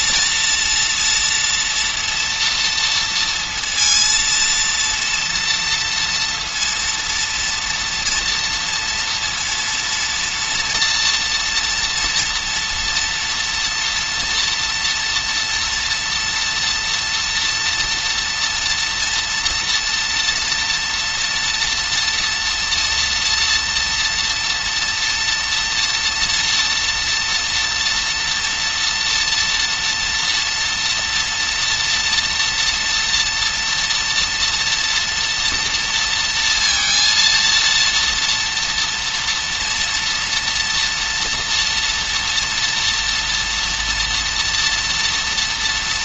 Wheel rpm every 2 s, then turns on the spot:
230, 230, 230, 230, 230, 230, 230, 230, 240, 240, 230, 230, 230, 240, 230, 230, 230, 230, 230, 230, 230, 230, 230.
none